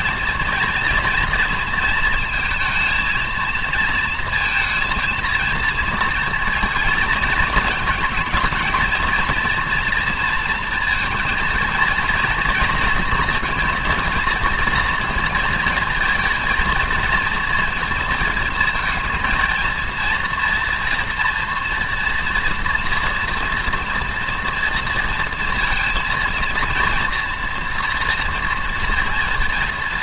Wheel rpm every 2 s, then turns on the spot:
230, 220, 230, 230, 230, 230, 230, 230, 230, 230, 230, 240, 230, 230, 230.
none